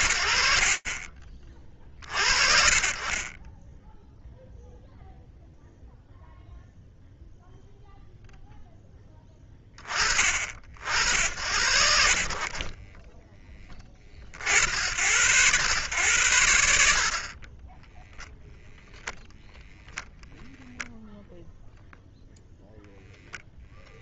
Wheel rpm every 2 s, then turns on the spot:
30, 0, 0, 0, 50, 60, 50, 90, 0, 0, 0, 0.
none